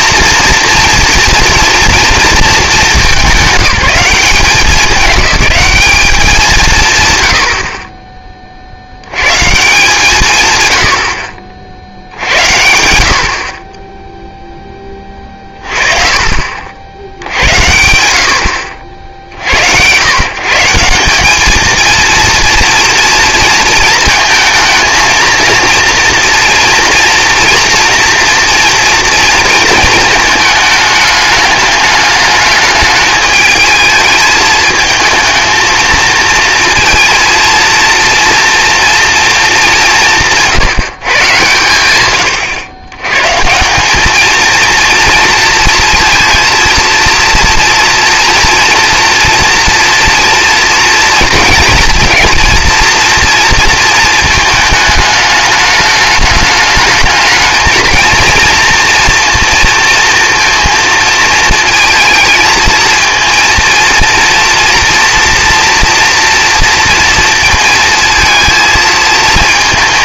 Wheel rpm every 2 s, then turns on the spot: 230, 200, 200, 140, 60, 110, 70, 10, 60, 70, 170, 230, 230, 230, 230, 210, 220, 220, 230, 230, 160, 100, 220, 230, 230, 230, 230, 220, 210, 230, 230, 220, 230, 230, 220.
none